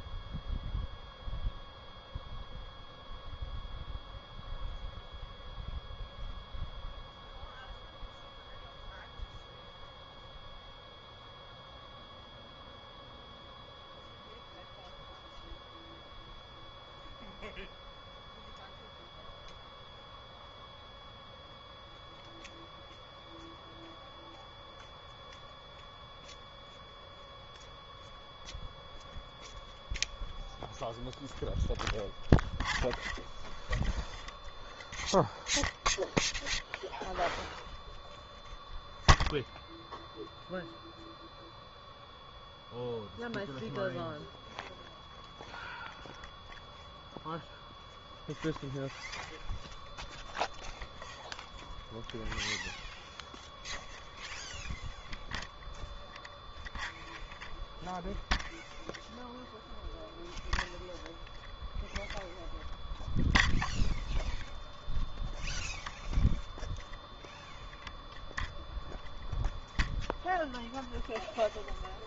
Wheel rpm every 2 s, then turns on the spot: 0, 0, 0, 0, 0, 0, 0, 0, 0, 0, 0, 0, 0, 0, 0, 0, 0, 0, 0, 0, 0, 0, 0, 0, 0, 0, 0, 0, 0, 0, 0, 0, 0, 0, 0, 0.
none